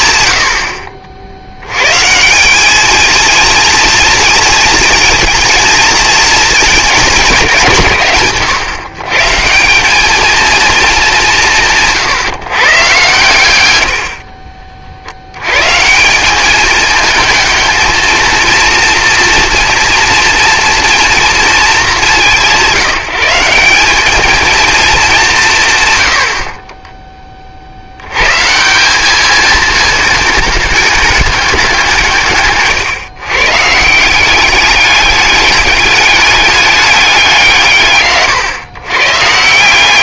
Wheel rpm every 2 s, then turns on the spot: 80, 210, 240, 220, 130, 220, 130, 50, 210, 230, 240, 180, 230, 30, 160, 210, 140, 200, 200, 100.
none